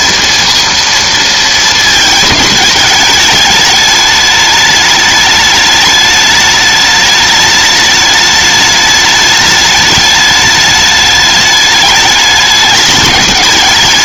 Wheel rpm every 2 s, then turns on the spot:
230, 210, 210, 210, 210, 210, 210.
none